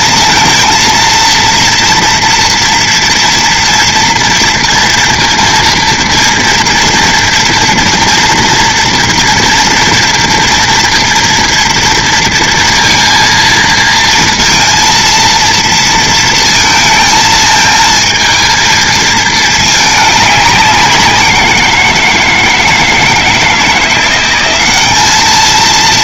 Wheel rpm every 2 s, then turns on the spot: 230, 230, 230, 230, 230, 230, 230, 230, 220, 220, 200, 160, 200.
none